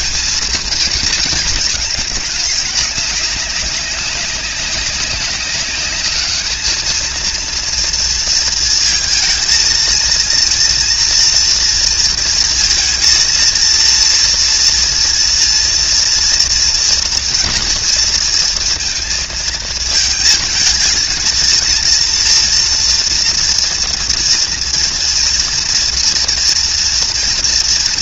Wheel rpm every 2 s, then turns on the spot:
230, 210, 200, 220, 230, 230, 230, 240, 230, 230, 220, 230, 230, 230.
none